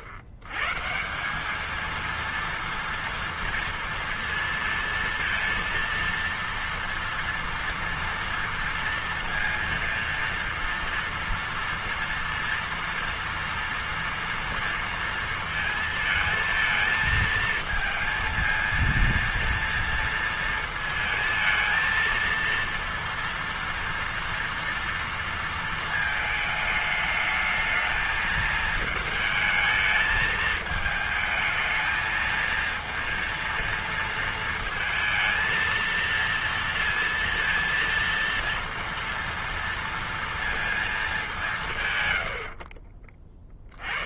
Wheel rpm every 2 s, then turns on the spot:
110, 230, 230, 230, 230, 230, 230, 230, 220, 230, 230, 230, 230, 220, 220, 220, 230, 230, 230, 230, 230, 70.
none